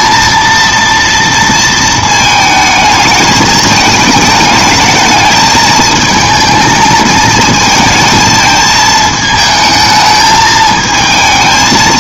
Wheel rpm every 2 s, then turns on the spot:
230, 220, 210, 220, 220, 220.
none